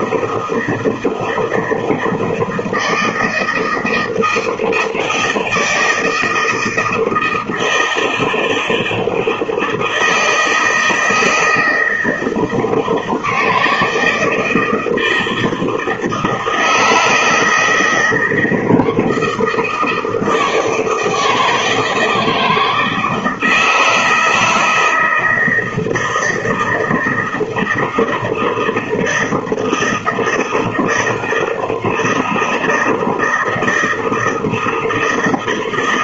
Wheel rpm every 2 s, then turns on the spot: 160, 160, 160, 160, 160, 160, 160, 160, 160, 170, 160, 160, 160, 160, 160, 160, 160, 160.
none